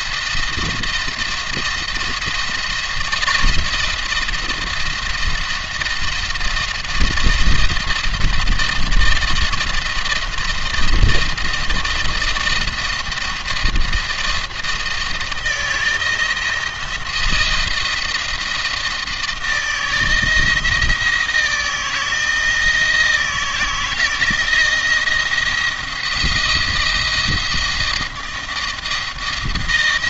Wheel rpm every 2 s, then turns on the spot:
170, 160, 160, 170, 170, 170, 170, 170, 170, 160, 160, 160, 160, 170, 170.
none